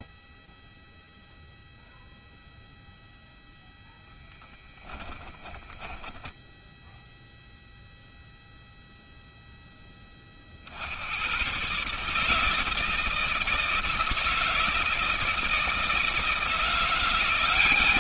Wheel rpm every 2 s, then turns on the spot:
0, 0, 10, 10, 0, 60, 160, 160, 180.
4-6